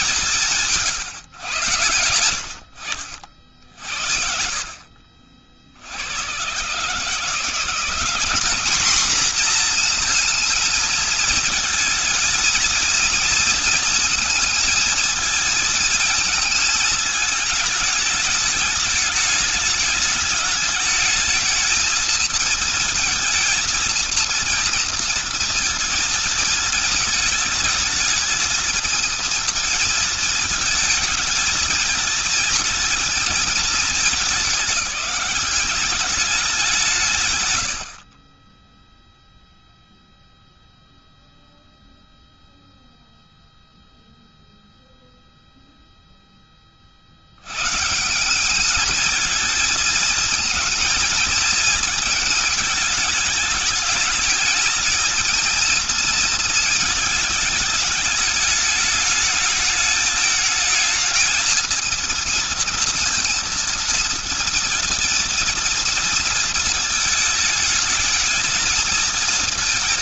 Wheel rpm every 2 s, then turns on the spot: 170, 70, 50, 100, 200, 230, 230, 230, 220, 210, 220, 230, 230, 220, 220, 220, 220, 210, 190, 20, 0, 0, 0, 10, 190, 230, 220, 210, 220, 210, 220, 230, 230, 220, 220.
none